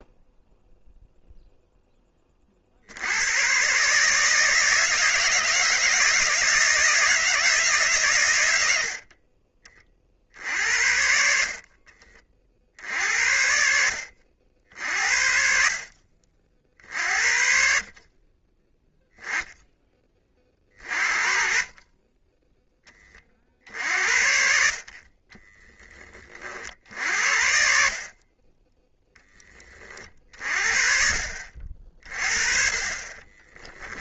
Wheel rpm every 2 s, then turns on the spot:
0, 50, 160, 160, 90, 60, 50, 60, 40, 10, 30, 10, 50, 50, 20, 50, 40.
none